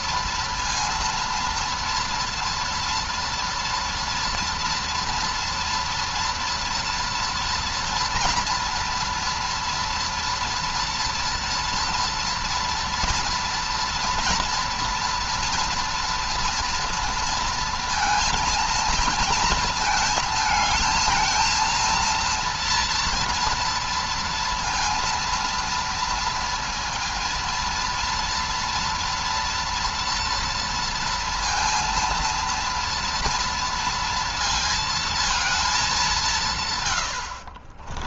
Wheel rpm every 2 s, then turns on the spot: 230, 230, 230, 240, 230, 230, 230, 240, 240, 220, 220, 230, 230, 230, 230, 230, 230, 230, 130.
none